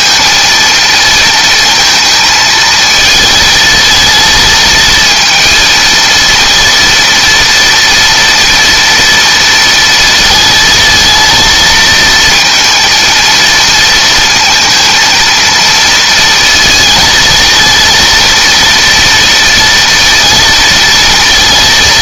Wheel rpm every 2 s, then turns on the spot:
230, 220, 220, 230, 230, 220, 230, 230, 230, 230, 230.
none